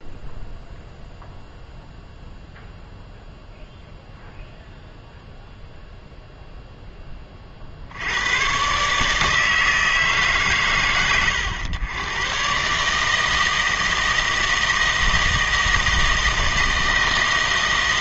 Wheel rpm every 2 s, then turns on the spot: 0, 0, 0, 10, 140, 120, 140, 160, 160.
none